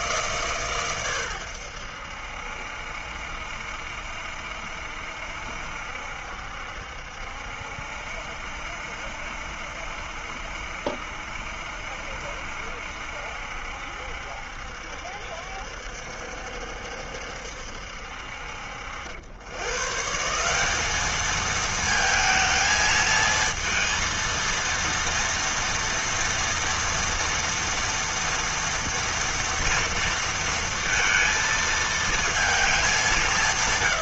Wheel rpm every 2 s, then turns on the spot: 150, 70, 70, 70, 70, 70, 70, 70, 70, 50, 170, 220, 230, 230, 230, 230, 220.
none